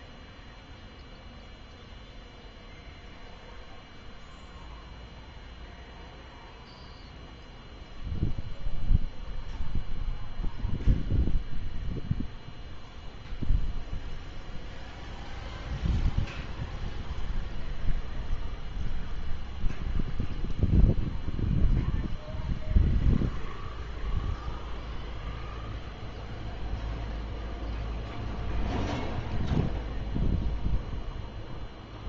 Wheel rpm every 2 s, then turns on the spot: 0, 0, 0, 0, 0, 0, 0, 0, 0, 0, 0, 0, 0, 0, 0, 0.
none